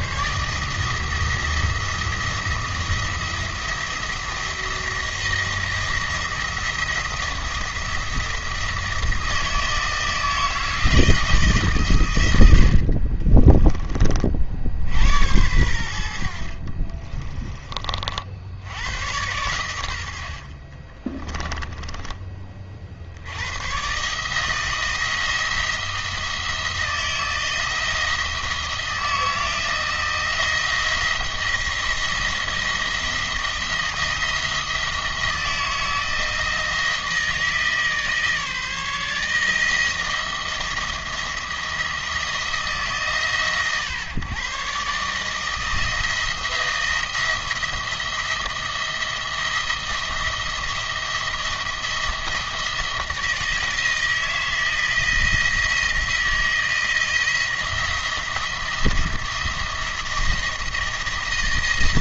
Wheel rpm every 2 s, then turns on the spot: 160, 170, 170, 170, 170, 160, 70, 60, 50, 70, 40, 40, 160, 160, 160, 170, 170, 170, 160, 150, 170, 160, 130, 170, 170, 170, 170, 160, 170, 170, 170.
16-18